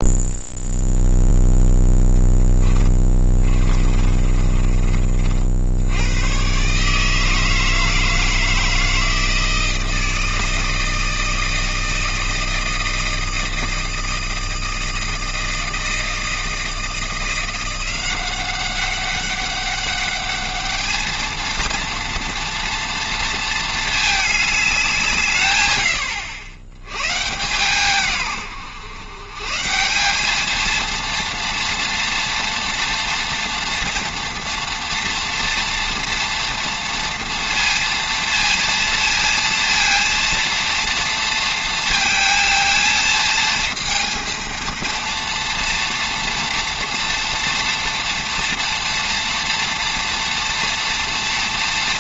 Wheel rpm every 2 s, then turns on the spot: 0, 20, 50, 150, 160, 160, 160, 160, 170, 200, 220, 230, 150, 130, 130, 230, 230, 230, 230, 230, 230, 220, 230, 230, 240, 230.
2-4